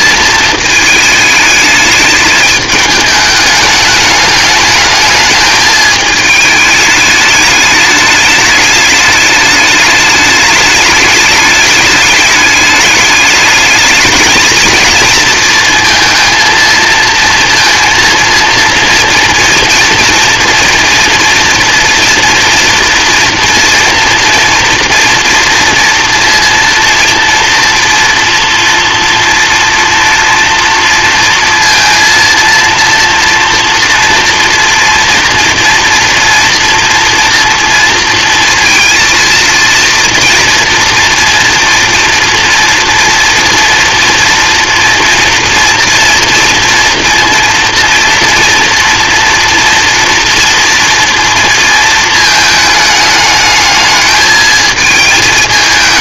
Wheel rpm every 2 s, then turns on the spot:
220, 210, 210, 210, 210, 210, 210, 220, 230, 230, 240, 240, 240, 230, 230, 230, 230, 240, 240, 230, 230, 230, 230, 230, 230, 230, 220, 220.
none